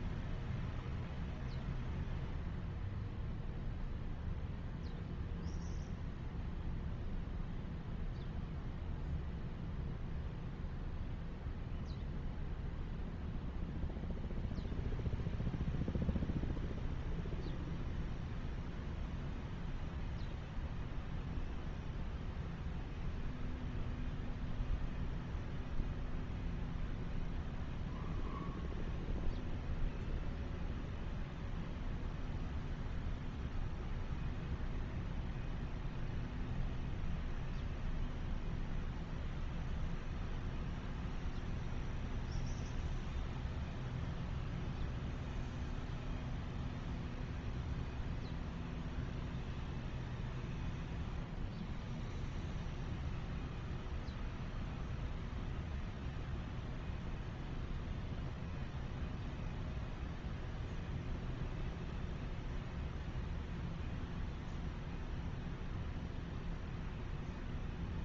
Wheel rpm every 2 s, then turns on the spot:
0, 0, 0, 0, 0, 0, 0, 0, 0, 0, 0, 0, 0, 0, 0, 0, 0, 0, 0, 0, 0, 0, 0, 0, 0, 0, 0, 0, 0, 0, 0, 0, 0, 0.
none